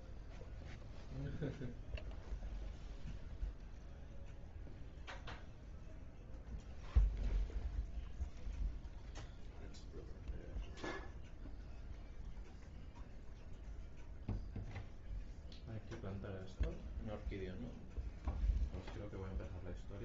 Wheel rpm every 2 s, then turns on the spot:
0, 0, 0, 0, 0, 0, 0, 0, 0, 0.
none